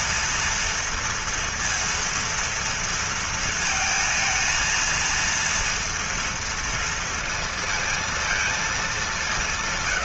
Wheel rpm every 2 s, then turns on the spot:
230, 230, 230, 230, 210.
none